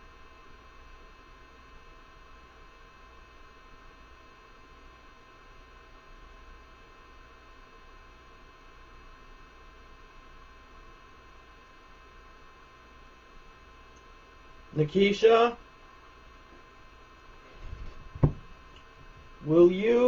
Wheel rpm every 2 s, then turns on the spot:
0, 0, 0, 0, 0, 0, 0, 0, 0, 0.
none